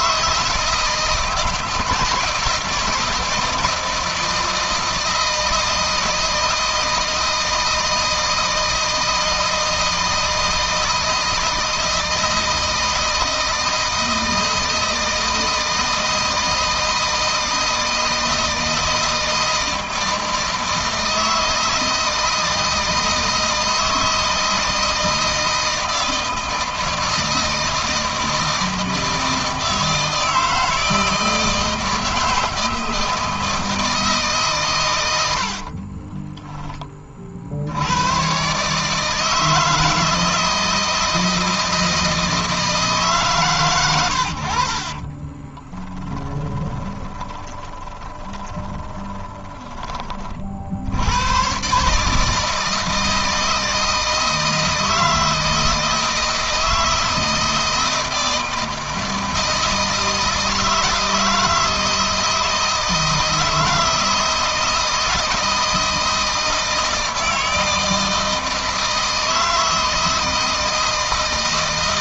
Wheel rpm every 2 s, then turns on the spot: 160, 160, 160, 160, 160, 160, 160, 160, 160, 160, 160, 160, 160, 160, 160, 160, 160, 100, 30, 150, 160, 150, 40, 20, 10, 80, 160, 160, 160, 160, 160, 160, 160, 160, 160, 160.
44-50